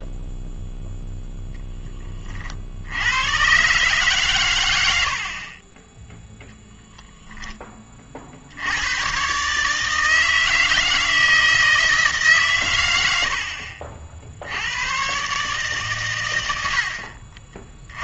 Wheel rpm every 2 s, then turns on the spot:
0, 40, 110, 0, 80, 160, 110, 80, 80.
none